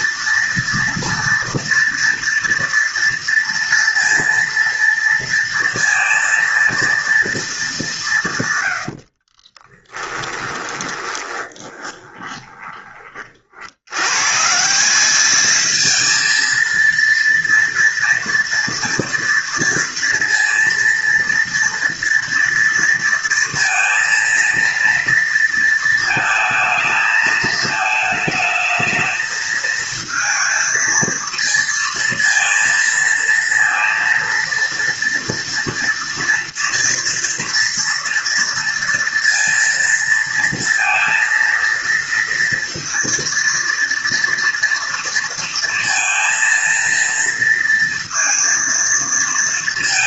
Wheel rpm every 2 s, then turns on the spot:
230, 230, 230, 220, 40, 20, 50, 210, 230, 230, 230, 230, 230, 220, 220, 230, 230, 230, 230, 230, 230, 230, 230, 230, 230.
8-12